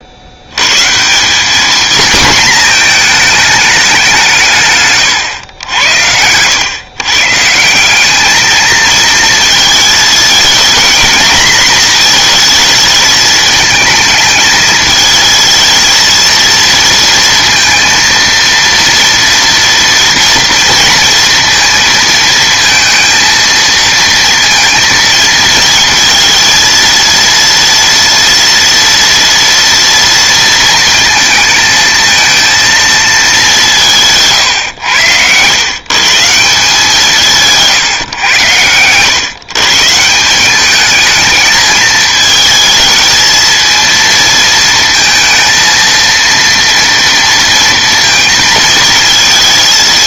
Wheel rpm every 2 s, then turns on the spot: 120, 230, 150, 110, 220, 230, 220, 220, 230, 230, 230, 230, 230, 230, 230, 230, 230, 120, 170, 100, 190, 220, 230, 230, 230.
none